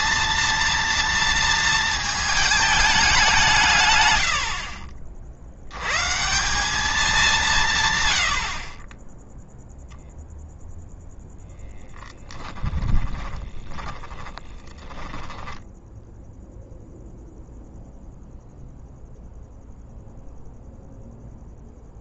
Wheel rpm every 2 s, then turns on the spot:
230, 200, 50, 200, 30, 0, 20, 20, 0, 0, 0.
12-16